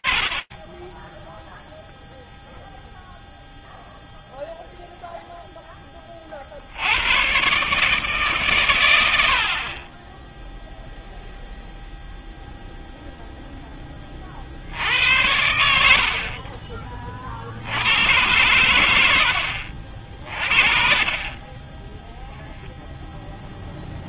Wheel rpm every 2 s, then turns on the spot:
0, 0, 0, 120, 80, 0, 10, 80, 70, 60, 10, 0.
none